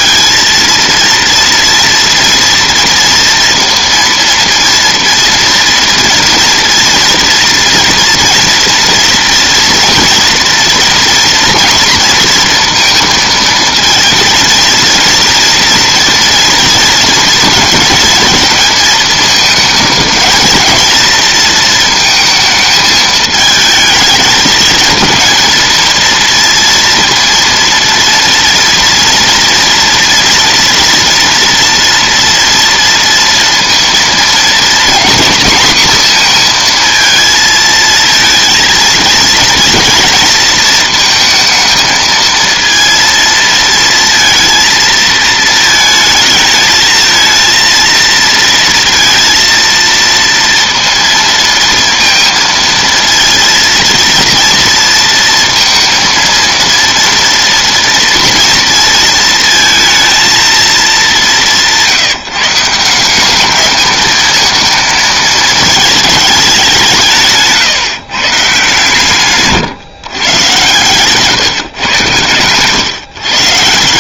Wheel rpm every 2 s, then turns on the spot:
230, 230, 230, 230, 230, 230, 230, 230, 230, 220, 230, 220, 220, 230, 230, 230, 230, 230, 230, 230, 230, 230, 230, 220, 230, 230, 230, 230, 230, 230, 200, 190, 220, 180, 150, 140, 140.
none